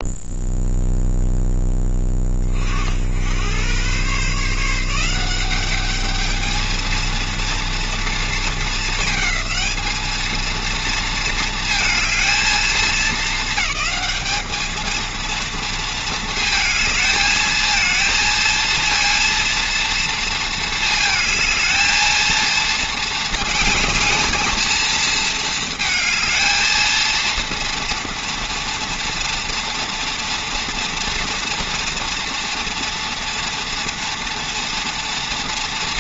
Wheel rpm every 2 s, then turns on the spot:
0, 60, 160, 230, 220, 230, 220, 220, 220, 230, 220, 220, 220, 230, 230, 230, 230, 230.
none